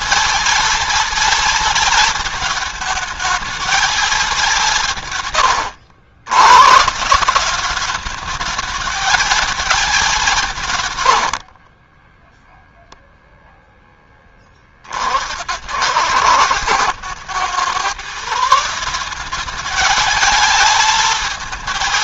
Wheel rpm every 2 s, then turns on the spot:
230, 220, 150, 160, 220, 110, 0, 60, 110, 180, 220.
10-12